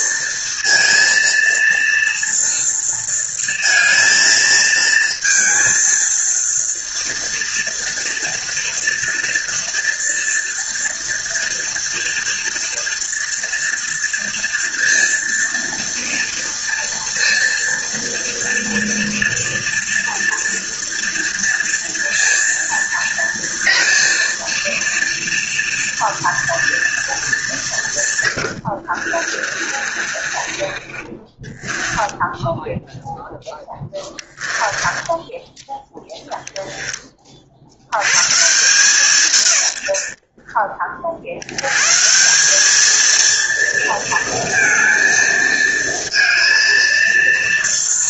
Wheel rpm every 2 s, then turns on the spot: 230, 230, 230, 230, 230, 230, 230, 230, 230, 230, 230, 230, 230, 230, 70, 30, 0, 10, 10, 150, 50, 220, 230, 230.
28-32 34-36